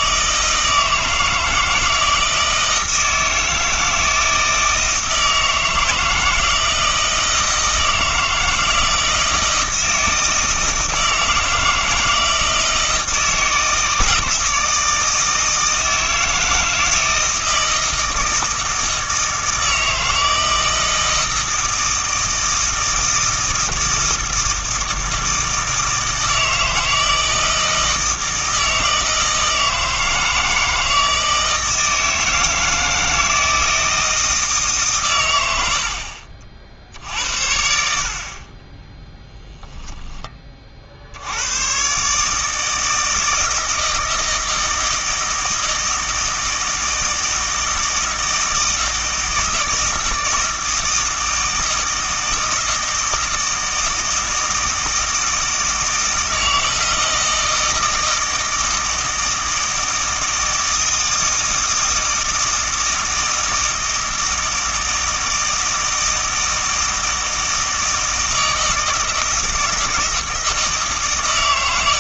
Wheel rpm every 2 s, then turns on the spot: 160, 160, 160, 160, 160, 160, 160, 160, 160, 160, 160, 160, 160, 160, 160, 160, 160, 130, 60, 10, 50, 160, 160, 160, 160, 160, 160, 160, 160, 160, 160, 160, 160, 160, 160, 150.
none